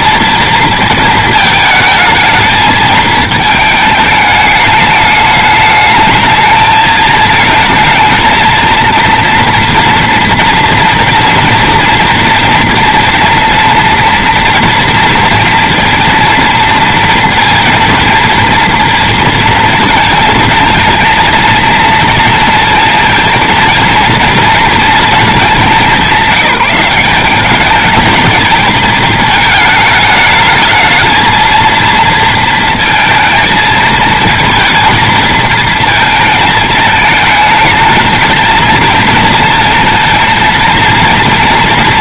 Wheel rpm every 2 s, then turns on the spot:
220, 220, 210, 220, 230, 230, 230, 230, 230, 230, 230, 230, 220, 190, 220, 220, 230, 230, 220, 220, 230.
none